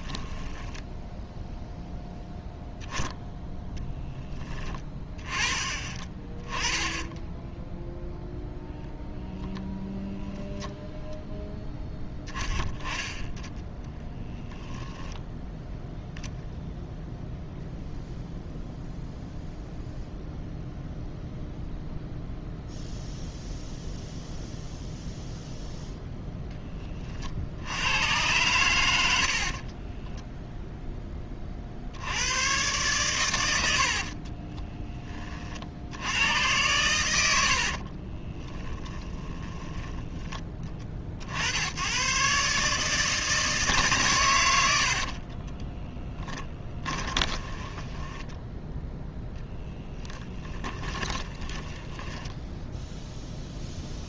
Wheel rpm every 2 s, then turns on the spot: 10, 0, 20, 10, 0, 0, 20, 0, 0, 0, 0, 0, 0, 20, 100, 10, 120, 10, 100, 10, 30, 150, 70, 20, 0, 20, 0.
0-2 6-8 38-40 46-48 50-52